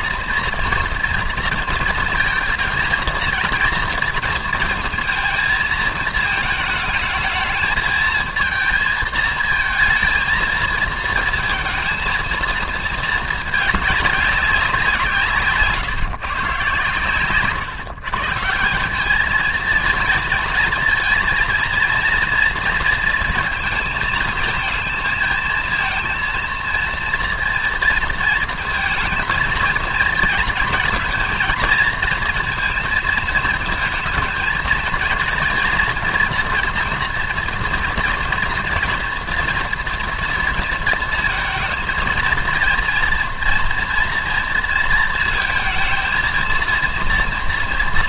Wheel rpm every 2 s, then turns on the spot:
240, 230, 230, 220, 220, 220, 230, 190, 140, 170, 220, 230, 220, 230, 220, 230, 230, 220, 230, 230, 230, 230, 230, 230.
none